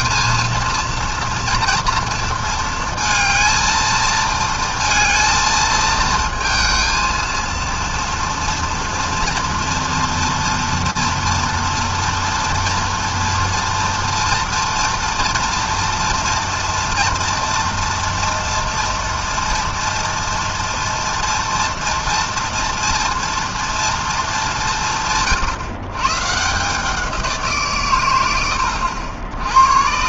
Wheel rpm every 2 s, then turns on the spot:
230, 230, 230, 220, 230, 230, 240, 230, 240, 230, 230, 230, 200, 150, 90.
none